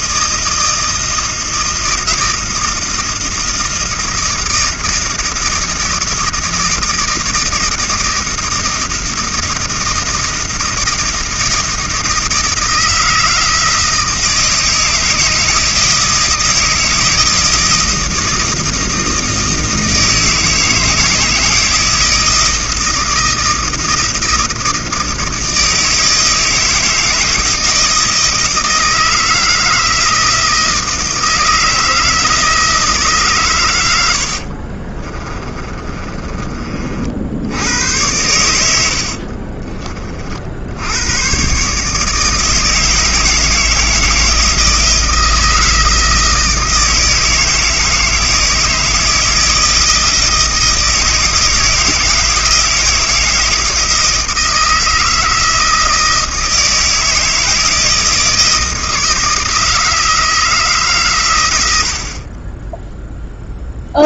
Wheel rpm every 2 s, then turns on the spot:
160, 160, 160, 160, 160, 160, 160, 160, 160, 160, 160, 160, 160, 160, 160, 160, 160, 50, 40, 100, 70, 160, 160, 160, 160, 160, 160, 160, 160, 160, 150, 10.
34-36